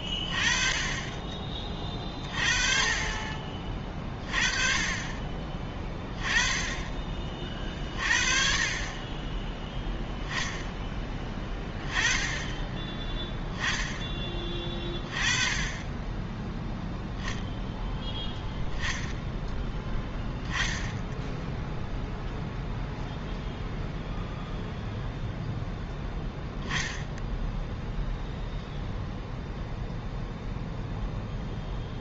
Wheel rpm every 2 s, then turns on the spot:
20, 40, 30, 20, 30, 10, 10, 30, 0, 0, 10, 0, 0, 0, 0, 0.
none